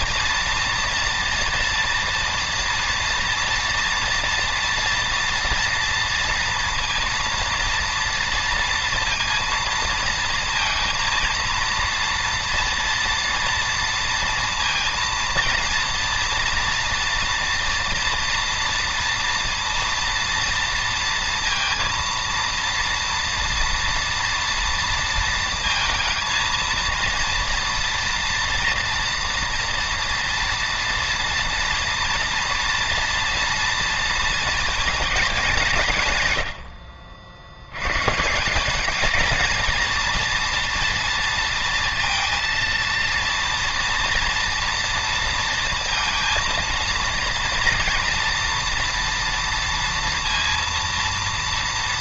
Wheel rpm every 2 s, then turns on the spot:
230, 240, 230, 230, 230, 230, 230, 230, 230, 230, 230, 230, 230, 230, 240, 230, 230, 230, 80, 190, 230, 230, 230, 230, 230, 230.
none